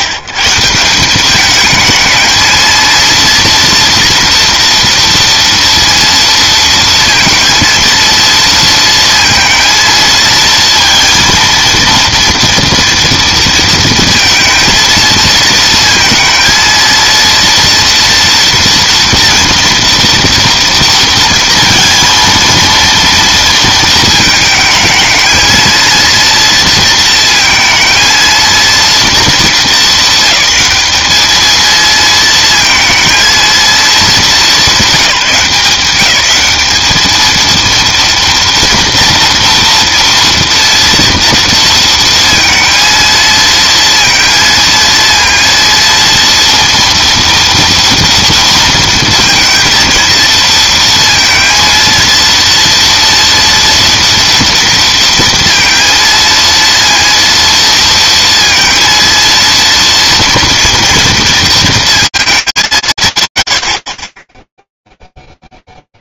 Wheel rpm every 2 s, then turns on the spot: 140, 220, 230, 230, 230, 230, 230, 230, 220, 230, 230, 230, 220, 230, 230, 220, 230, 210, 190, 230, 230, 230, 230, 230, 230, 230, 230, 230, 230, 230, 230, 210, 10.
none